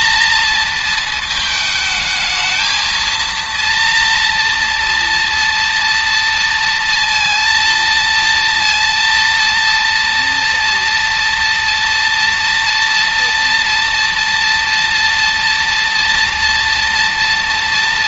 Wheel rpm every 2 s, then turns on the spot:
220, 220, 230, 230, 230, 230, 230, 230, 230.
none